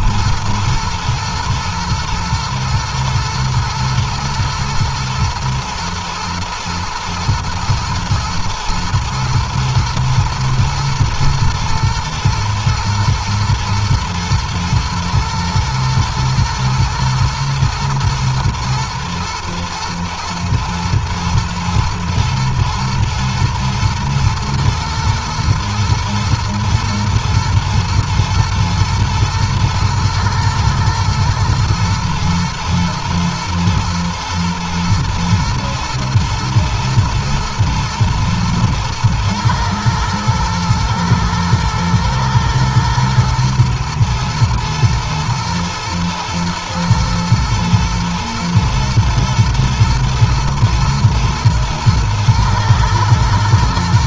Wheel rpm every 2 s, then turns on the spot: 110, 110, 110, 120, 110, 110, 110, 120, 110, 120, 110, 110, 120, 120, 120, 120, 110, 120, 110, 110, 110, 110, 110, 120, 110, 110, 110.
none